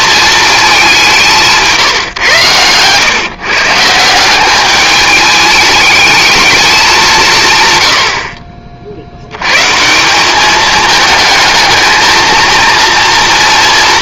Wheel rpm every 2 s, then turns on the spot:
200, 110, 200, 200, 60, 210, 230.
none